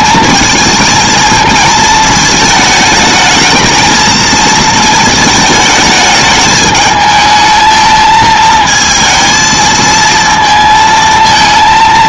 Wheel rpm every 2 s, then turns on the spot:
220, 220, 220, 210, 220, 220.
none